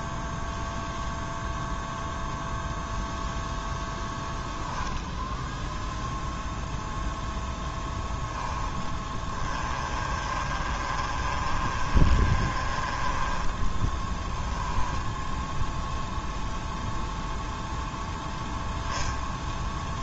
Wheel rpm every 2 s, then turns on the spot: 0, 0, 10, 0, 10, 30, 30, 10, 0, 0.
8-16